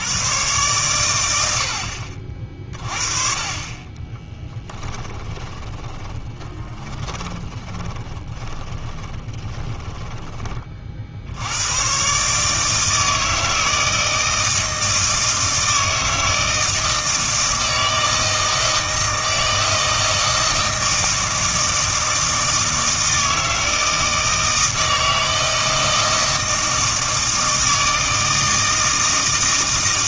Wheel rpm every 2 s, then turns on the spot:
120, 40, 20, 20, 20, 40, 160, 160, 160, 160, 160, 160, 160, 160, 160.
4-10